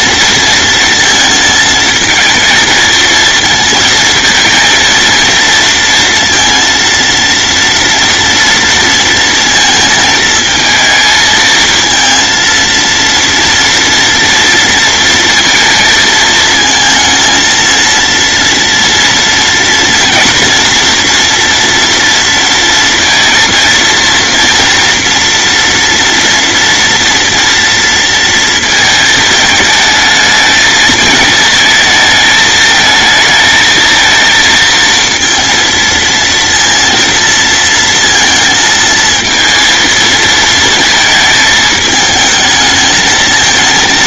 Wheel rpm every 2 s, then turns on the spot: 230, 220, 230, 230, 230, 220, 230, 230, 230, 230, 230, 230, 230, 230, 230, 220, 220, 230, 230, 230, 220, 220.
none